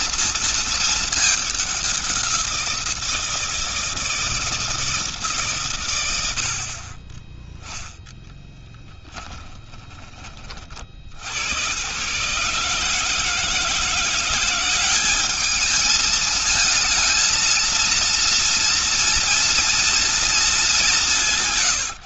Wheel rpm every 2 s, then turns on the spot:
230, 180, 160, 80, 10, 30, 140, 180, 220, 230, 220.
8-10